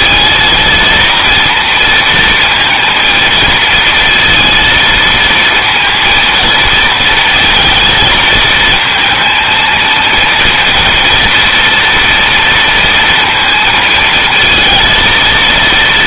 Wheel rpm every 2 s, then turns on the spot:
230, 230, 230, 220, 230, 230, 230, 220.
none